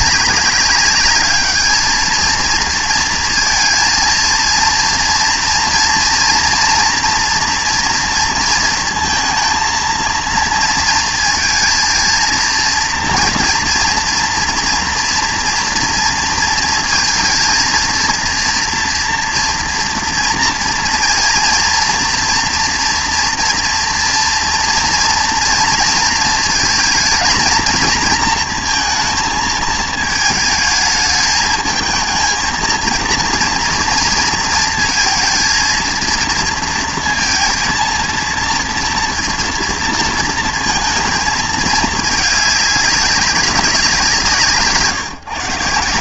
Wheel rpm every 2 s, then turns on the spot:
200, 230, 230, 230, 230, 230, 230, 230, 230, 240, 230, 230, 240, 230, 230, 220, 230, 230, 230, 230, 230, 210, 150.
none